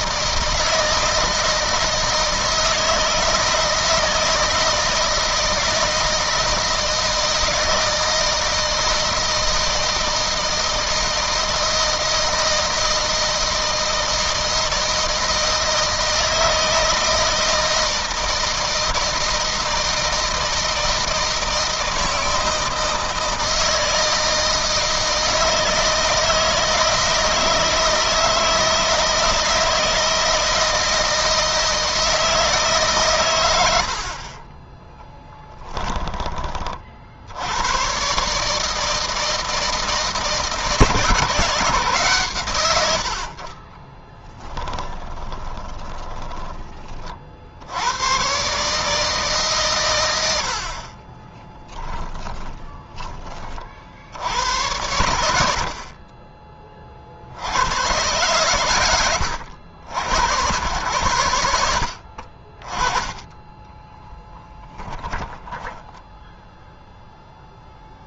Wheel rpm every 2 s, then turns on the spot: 160, 160, 160, 160, 160, 160, 160, 160, 160, 160, 160, 160, 160, 160, 160, 160, 150, 30, 30, 150, 160, 110, 10, 20, 130, 60, 20, 90, 30, 110, 110, 40, 20, 0.
34-36 44-46 52-54 64-66